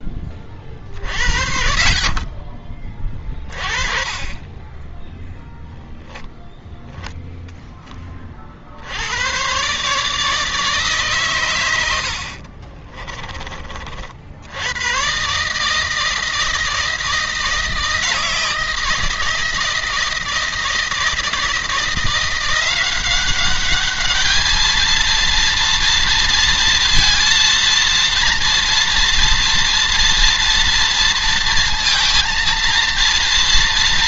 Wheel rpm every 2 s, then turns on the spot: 30, 30, 20, 20, 60, 150, 40, 100, 160, 160, 160, 180, 220, 230, 230, 230, 230.
4-8 12-14